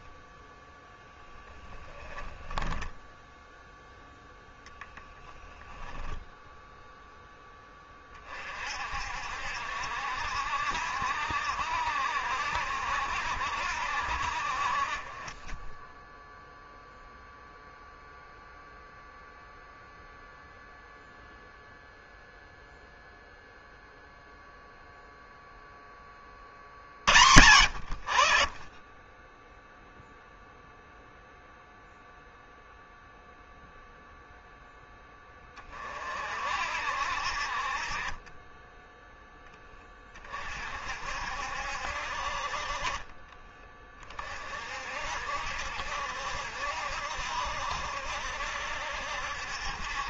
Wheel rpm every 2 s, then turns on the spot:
0, 10, 10, 10, 50, 70, 70, 40, 0, 0, 0, 0, 0, 70, 10, 0, 0, 10, 60, 10, 50, 40, 50, 70, 60.
2-4